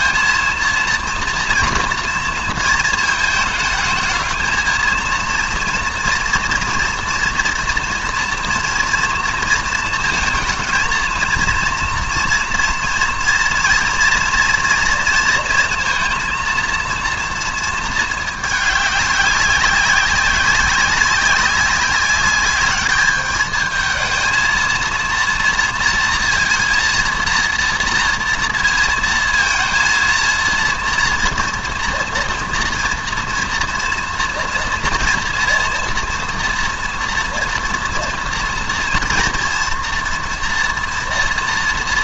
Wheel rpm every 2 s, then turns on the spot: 230, 230, 220, 230, 230, 220, 230, 230, 230, 210, 200, 200, 230, 230, 230, 230, 230, 230, 230, 240, 240.
none